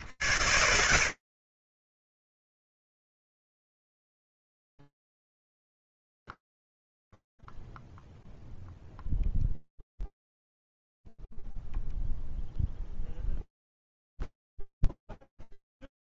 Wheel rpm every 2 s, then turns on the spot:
100, 0, 0, 0, 0, 0, 0, 0.
none